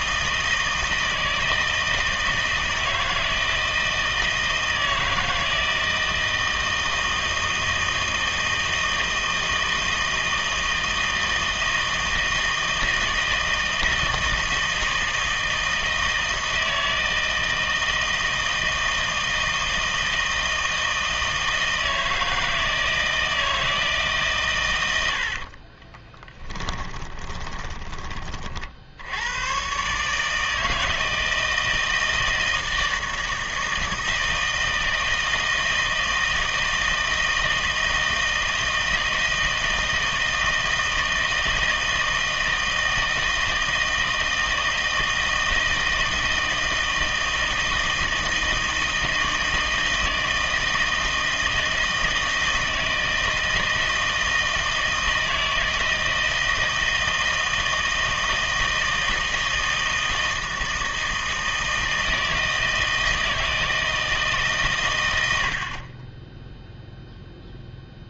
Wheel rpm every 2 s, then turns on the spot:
160, 170, 160, 160, 160, 160, 160, 160, 160, 160, 160, 160, 100, 20, 60, 160, 160, 160, 160, 160, 160, 160, 160, 160, 160, 160, 160, 160, 160, 160, 160, 160, 130, 0.
26-28